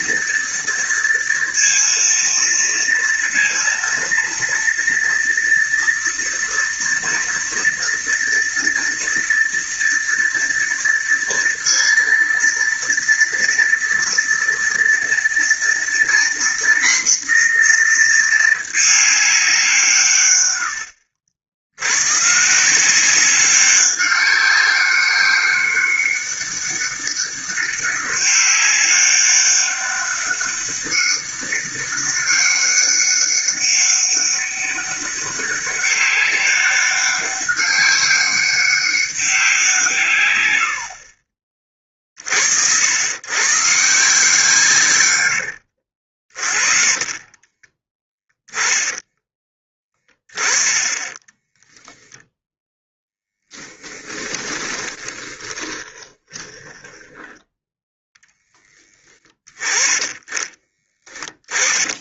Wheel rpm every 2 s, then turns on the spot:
230, 230, 230, 230, 230, 230, 230, 230, 240, 210, 70, 180, 200, 200, 200, 200, 200, 200, 200, 200, 90, 80, 150, 40, 10, 20, 0, 20, 30, 10, 20.
46-50 54-58 60-62